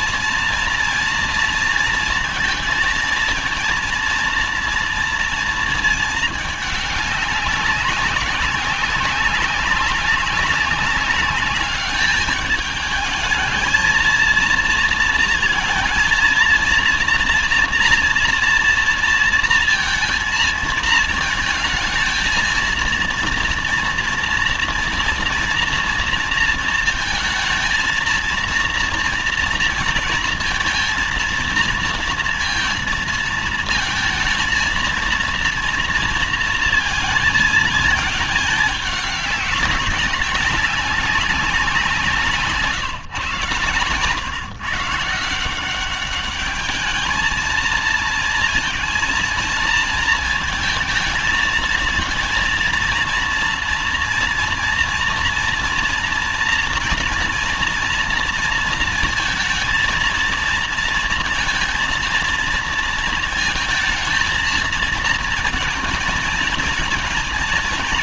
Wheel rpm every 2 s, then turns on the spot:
230, 230, 230, 210, 190, 190, 210, 230, 240, 230, 220, 230, 230, 230, 230, 230, 230, 230, 230, 210, 190, 170, 150, 200, 230, 220, 230, 230, 240, 230, 230, 230, 230, 230.
none